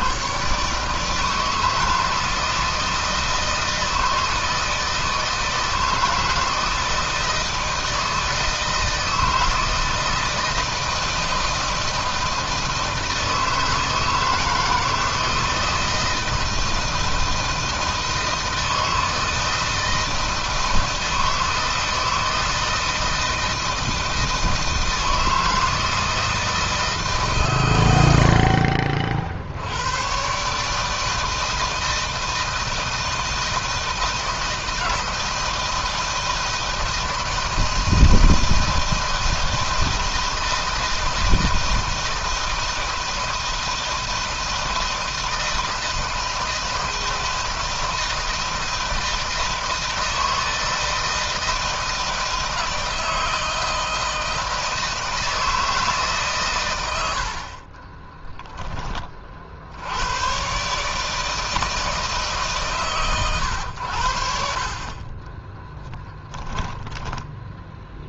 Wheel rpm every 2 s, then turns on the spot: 150, 160, 160, 160, 160, 160, 160, 160, 160, 160, 160, 160, 160, 160, 50, 150, 170, 160, 160, 160, 160, 160, 160, 160, 160, 160, 160, 160, 110, 20, 140, 140, 40, 10.
66-68